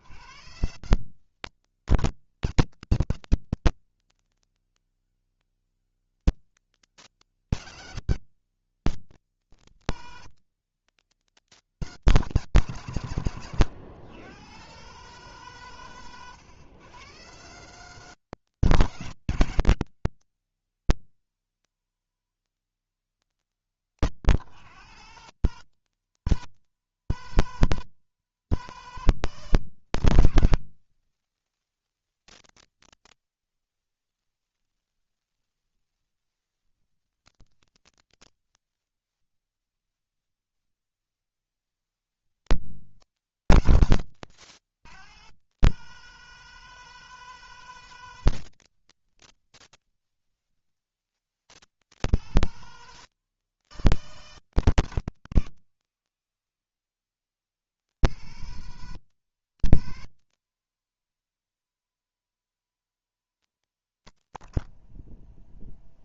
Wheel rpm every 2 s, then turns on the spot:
140, 160, 160, 160, 110, 110, 120, 140, 110, 150, 120, 100, 120, 160, 160, 160, 160, 150, 120, 50, 20, 110, 100, 160, 130, 30, 150, 160, 60, 150, 160, 160, 30.
38-40